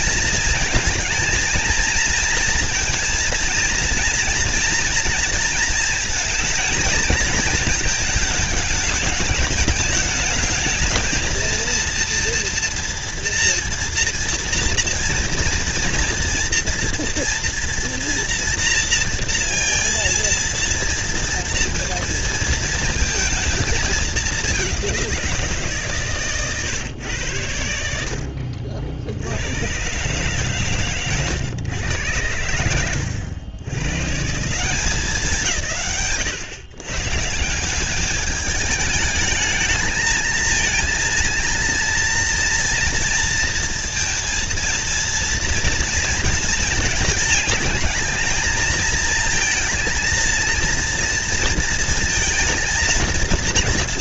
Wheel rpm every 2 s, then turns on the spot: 230, 230, 230, 230, 210, 220, 230, 230, 230, 230, 230, 230, 200, 130, 60, 130, 100, 150, 100, 210, 230, 230, 230, 220, 220, 230, 230.
none